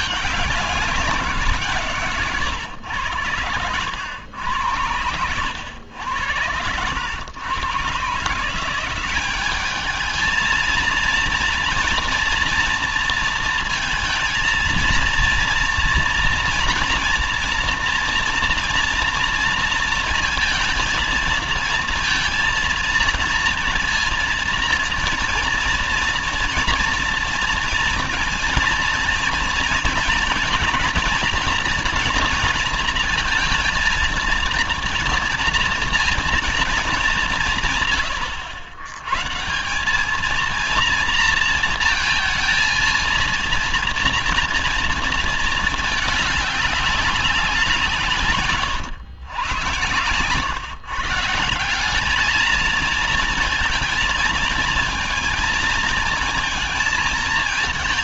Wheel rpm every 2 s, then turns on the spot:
200, 120, 80, 90, 170, 220, 230, 230, 230, 230, 230, 230, 230, 230, 230, 220, 230, 230, 230, 90, 230, 230, 230, 200, 130, 120, 220, 220, 220.
none